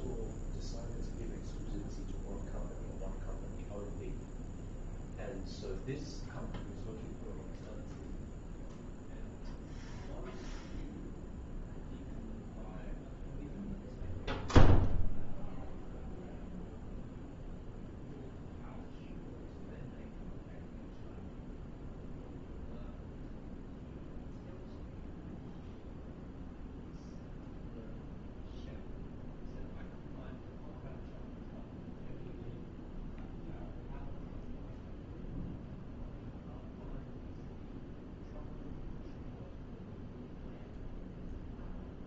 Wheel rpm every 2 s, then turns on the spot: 0, 0, 0, 0, 0, 0, 0, 0, 0, 0, 0, 0, 0, 0, 0, 0, 0, 0, 0, 0, 0.
none